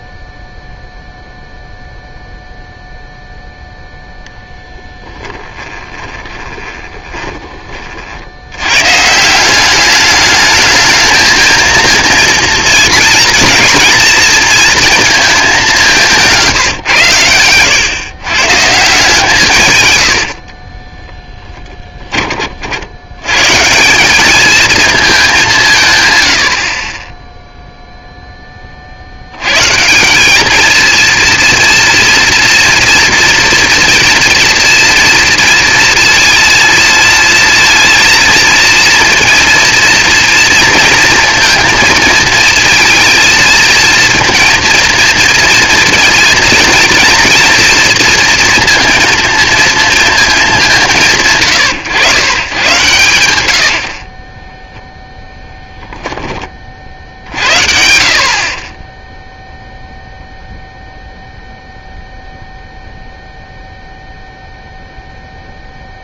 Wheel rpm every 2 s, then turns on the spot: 0, 0, 0, 20, 90, 220, 230, 220, 140, 140, 40, 60, 220, 40, 30, 220, 230, 230, 230, 230, 230, 230, 230, 230, 230, 190, 120, 10, 30, 30, 0, 0, 0.
6-8 20-22 54-56